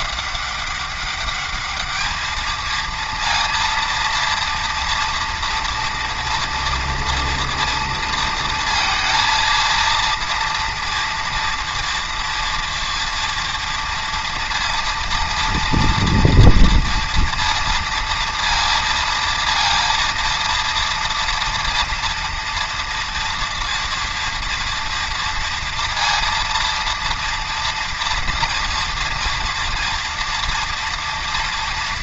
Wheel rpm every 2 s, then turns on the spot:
200, 230, 230, 230, 230, 230, 230, 230, 230, 230, 230, 230, 230, 230, 230, 230.
none